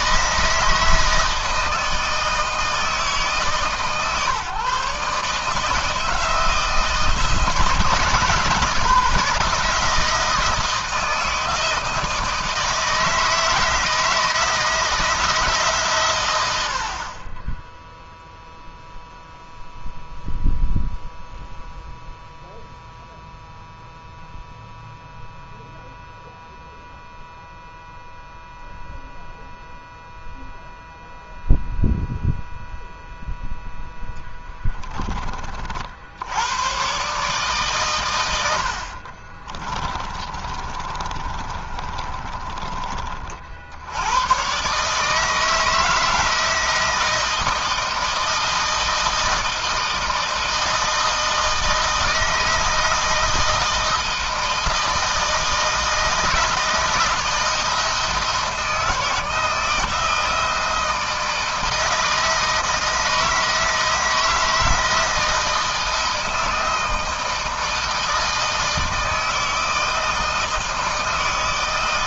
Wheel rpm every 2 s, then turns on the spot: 160, 160, 140, 170, 150, 160, 160, 160, 60, 0, 0, 0, 0, 0, 0, 0, 0, 20, 120, 50, 30, 30, 130, 160, 160, 160, 160, 160, 160, 160, 160, 160, 160, 160, 160, 160.
38-42